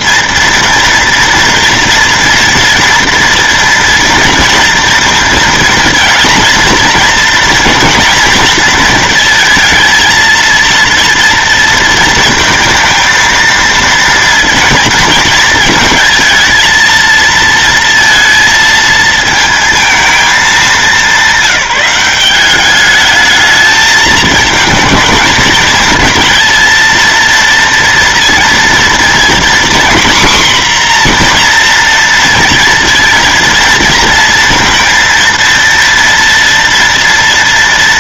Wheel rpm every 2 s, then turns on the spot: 230, 230, 230, 230, 230, 230, 230, 230, 230, 230, 210, 200, 220, 230, 230, 250, 230, 230, 230.
none